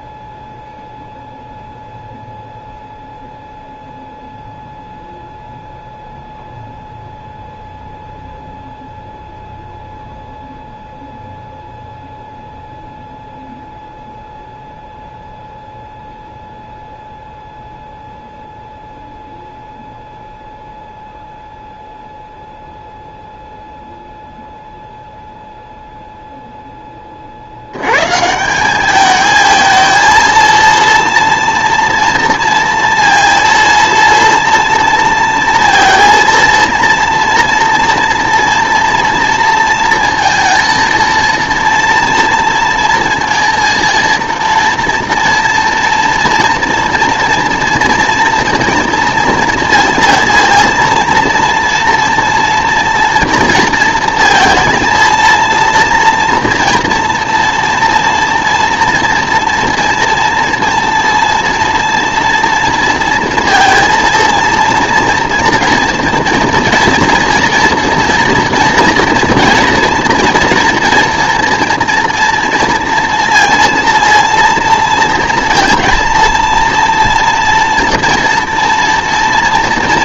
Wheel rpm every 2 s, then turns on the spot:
0, 0, 0, 0, 0, 0, 0, 0, 0, 0, 0, 0, 0, 10, 190, 230, 230, 230, 230, 230, 230, 230, 230, 230, 230, 230, 230, 230, 240, 230, 230, 230, 230, 230, 240, 230, 230, 230, 230, 230.
none